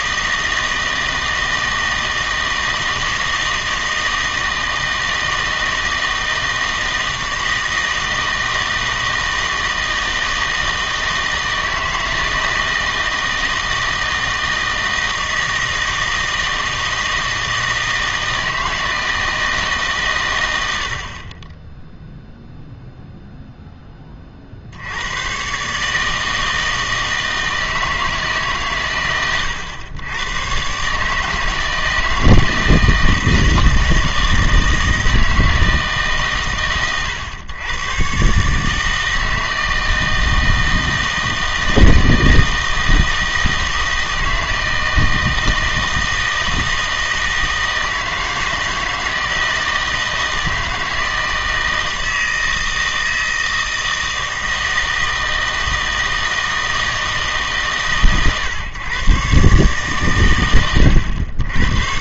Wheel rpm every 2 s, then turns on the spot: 160, 160, 160, 160, 160, 160, 160, 160, 160, 160, 90, 0, 50, 160, 130, 120, 160, 160, 120, 140, 160, 160, 160, 160, 160, 160, 160, 160, 160, 130, 100.
none